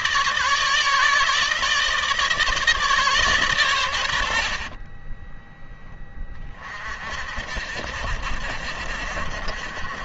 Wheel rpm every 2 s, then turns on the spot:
150, 150, 40, 30, 60.
4-6